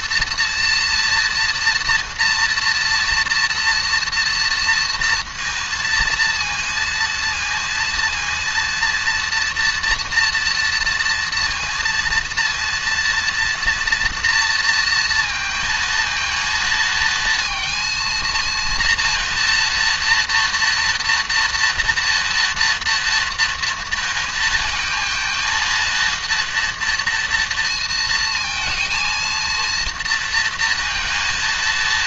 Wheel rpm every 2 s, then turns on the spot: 240, 240, 230, 230, 230, 230, 230, 230, 230, 230, 230, 230, 220, 230, 230, 230.
none